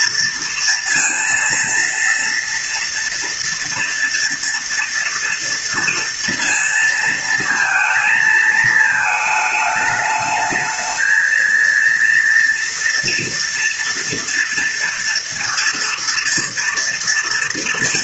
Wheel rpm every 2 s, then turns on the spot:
230, 230, 230, 230, 220, 220, 230, 230, 230.
none